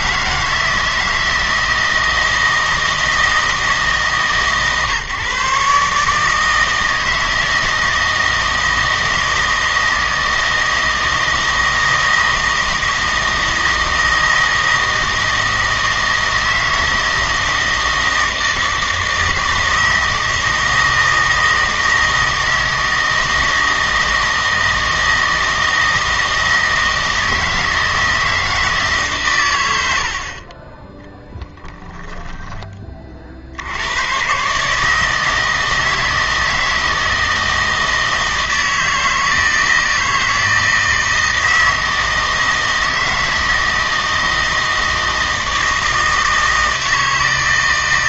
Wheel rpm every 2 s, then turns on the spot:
160, 160, 140, 160, 160, 160, 160, 160, 160, 160, 160, 160, 160, 160, 160, 20, 20, 150, 160, 160, 160, 160, 160, 160.
none